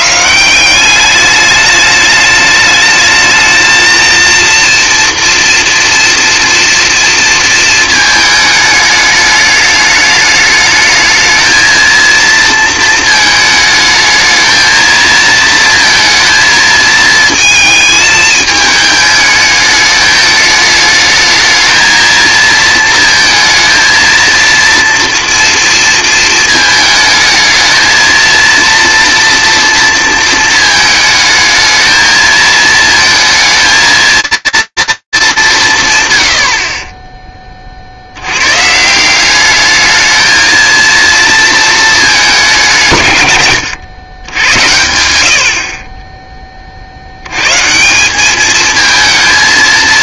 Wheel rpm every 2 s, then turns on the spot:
190, 210, 230, 230, 210, 220, 230, 220, 220, 220, 210, 230, 230, 220, 230, 220, 230, 230, 50, 110, 220, 180, 100, 40, 220.
none